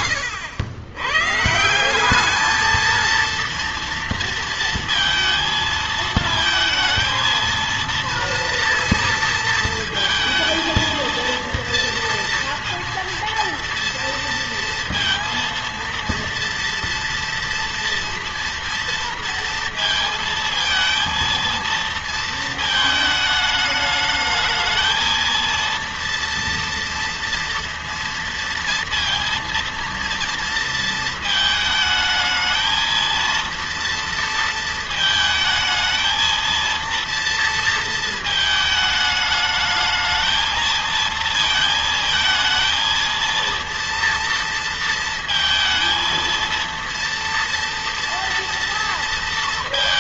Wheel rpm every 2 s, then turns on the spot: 100, 220, 230, 230, 230, 230, 230, 230, 230, 230, 230, 220, 220, 230, 230, 230, 220, 230, 230, 220, 220, 220, 230, 230, 230.
none